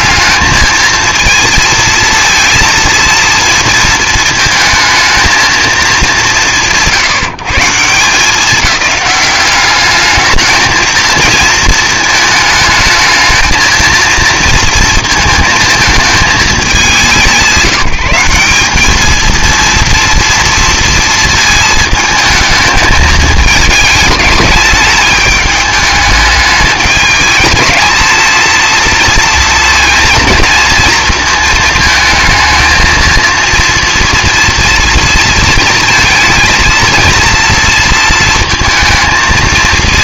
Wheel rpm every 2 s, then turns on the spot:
220, 230, 220, 160, 210, 220, 220, 230, 200, 210, 230, 220, 210, 210, 230, 230, 230, 230, 230, 230.
none